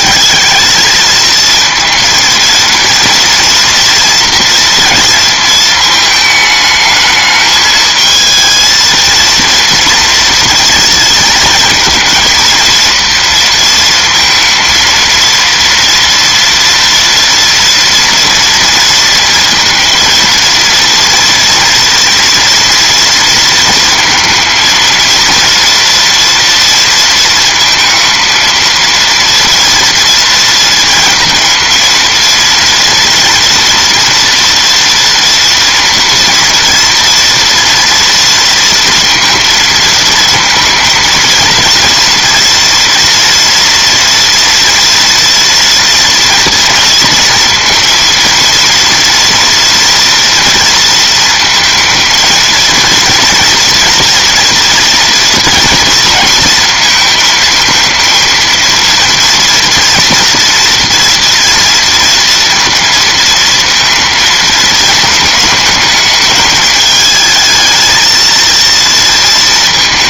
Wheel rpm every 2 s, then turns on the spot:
210, 230, 230, 220, 230, 230, 230, 230, 230, 230, 230, 230, 220, 230, 230, 230, 240, 230, 240, 230, 230, 230, 230, 230, 230, 230, 230, 230, 220, 230, 230, 230, 220, 210, 230.
none